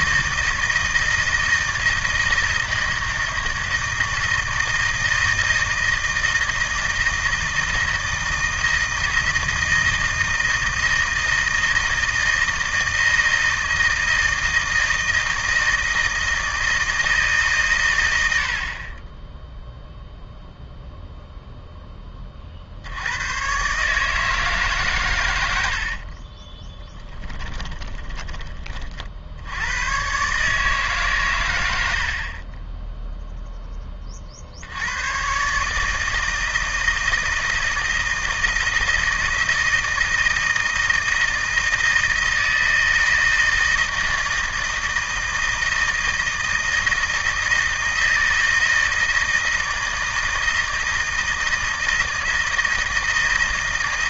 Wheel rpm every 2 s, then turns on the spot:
160, 160, 160, 160, 160, 160, 160, 160, 160, 50, 0, 60, 140, 20, 50, 150, 20, 80, 160, 160, 160, 160, 160, 160, 160, 160, 160.
26-28